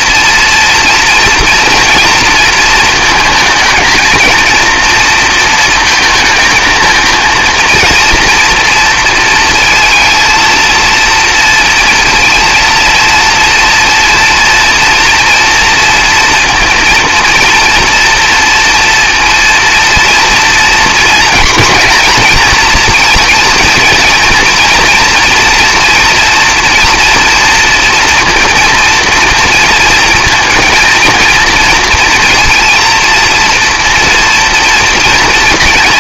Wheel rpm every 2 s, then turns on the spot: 230, 230, 230, 220, 230, 230, 230, 230, 230, 230, 240, 230, 240, 230, 230, 230, 230, 230.
none